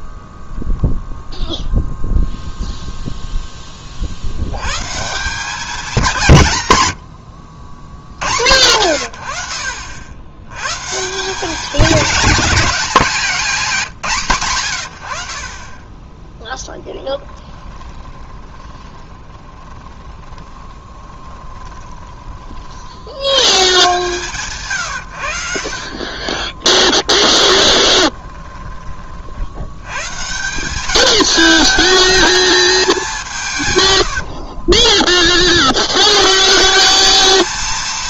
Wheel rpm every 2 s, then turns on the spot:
0, 0, 140, 120, 100, 140, 200, 100, 10, 20, 20, 70, 130, 20, 30, 200, 210, 30, 180.
16-22 26-28 34-36